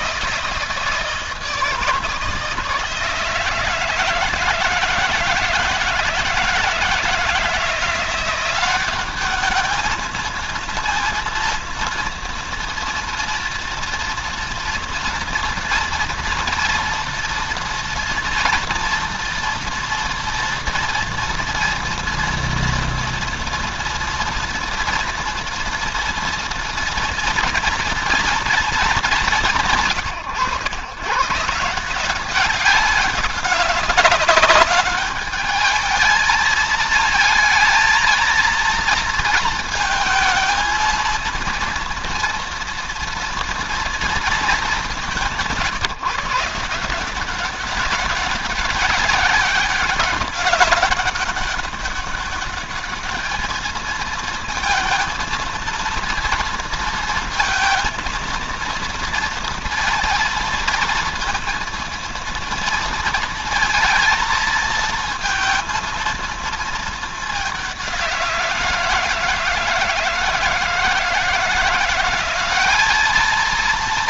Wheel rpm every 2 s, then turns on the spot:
160, 160, 160, 160, 190, 230, 230, 240, 240, 230, 230, 230, 230, 230, 200, 110, 190, 210, 220, 230, 230, 240, 190, 160, 190, 200, 210, 220, 230, 230, 230, 230, 220, 220, 170, 160, 210.
none